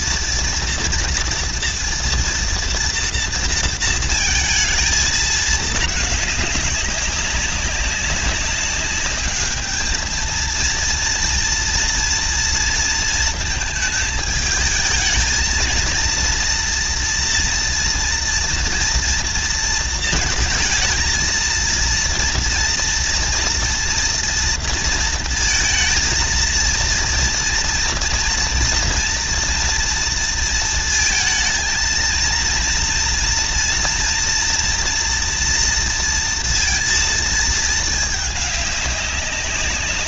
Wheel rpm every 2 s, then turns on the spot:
230, 230, 220, 200, 190, 230, 230, 220, 230, 230, 230, 230, 230, 230, 230, 230, 230, 240, 230, 210.
none